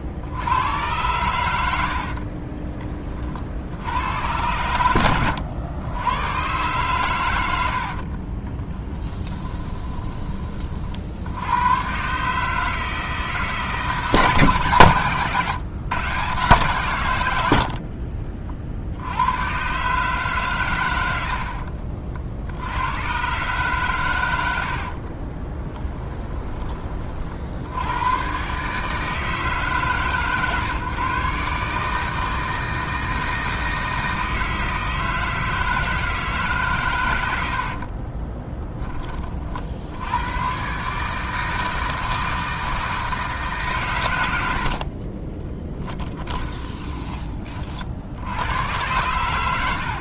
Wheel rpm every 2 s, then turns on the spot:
100, 30, 100, 120, 10, 40, 160, 130, 140, 60, 110, 100, 60, 30, 150, 130, 160, 160, 130, 10, 130, 160, 60, 20, 110.
2-4 8-10 24-26 44-48